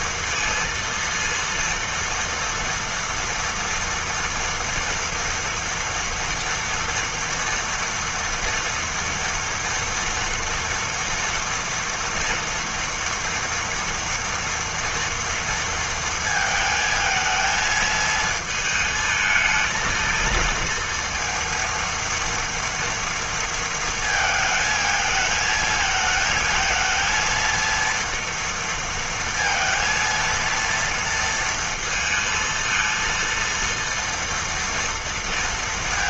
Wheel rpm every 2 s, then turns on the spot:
230, 230, 230, 230, 230, 230, 230, 230, 220, 220, 230, 230, 220, 220, 230, 230, 230, 230.
none